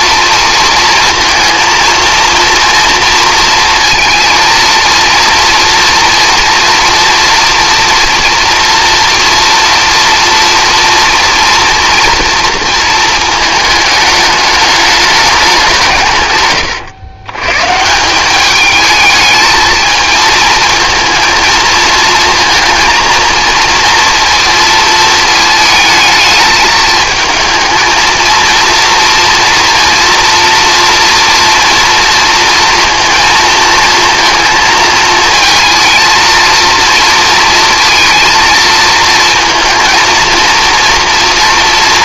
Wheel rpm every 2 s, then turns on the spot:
240, 230, 230, 230, 230, 240, 230, 210, 120, 210, 220, 230, 230, 220, 230, 230, 230, 220, 230, 230, 230.
none